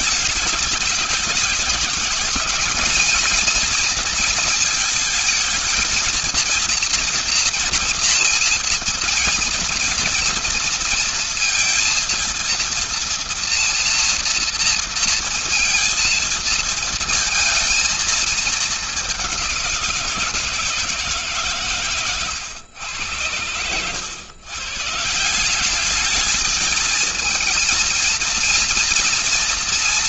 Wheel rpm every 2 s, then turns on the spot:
200, 230, 220, 230, 230, 230, 230, 230, 230, 190, 140, 100, 190, 230, 230.
none